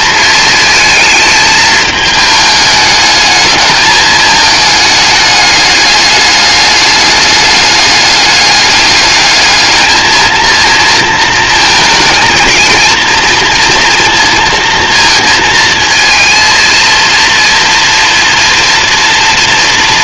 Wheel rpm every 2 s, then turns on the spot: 220, 210, 210, 210, 210, 230, 230, 230, 230, 230.
none